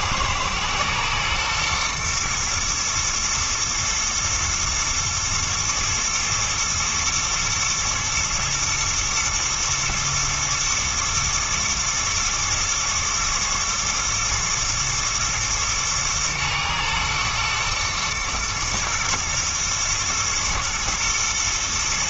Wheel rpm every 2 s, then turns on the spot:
110, 120, 110, 120, 120, 120, 120, 120, 110, 110, 120.
none